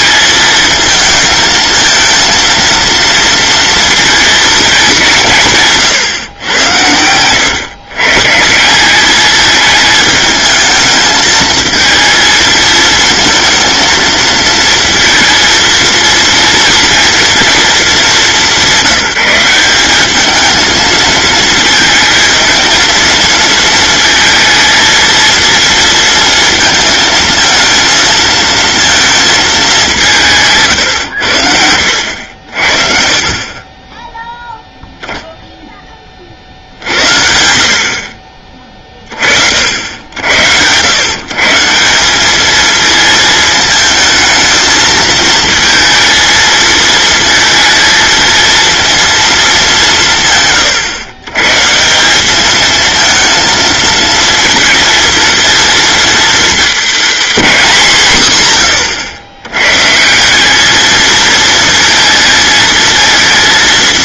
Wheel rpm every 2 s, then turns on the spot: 220, 230, 210, 100, 180, 220, 220, 230, 230, 170, 220, 230, 230, 230, 230, 120, 50, 0, 70, 30, 110, 220, 220, 220, 230, 130, 220, 220, 220, 90, 220, 220.
6-8